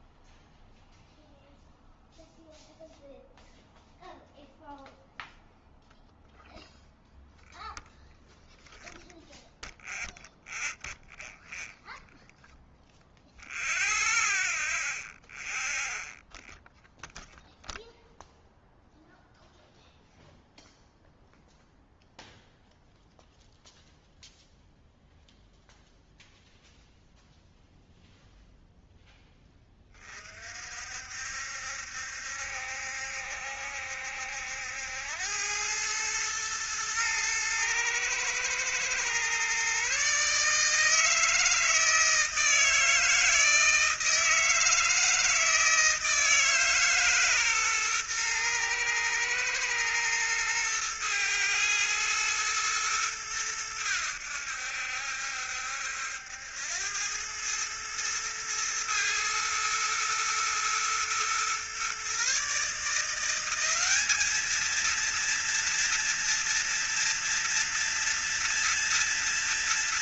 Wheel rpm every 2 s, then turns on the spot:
0, 0, 0, 0, 0, 0, 0, 0, 0, 0, 0, 0, 0, 0, 0, 60, 70, 80, 110, 120, 160, 160, 160, 150, 120, 110, 110, 70, 90, 110, 120, 160, 230, 240, 230.
none